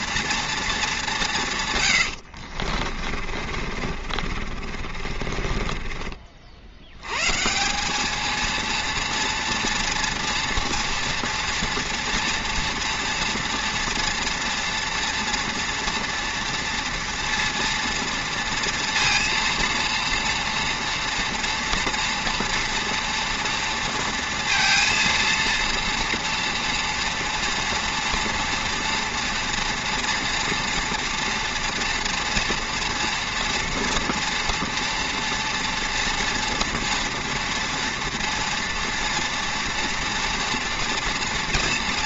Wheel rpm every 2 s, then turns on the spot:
220, 50, 40, 70, 230, 230, 230, 230, 240, 230, 230, 230, 230, 230, 240, 230, 240, 230, 240, 230, 240.
2-6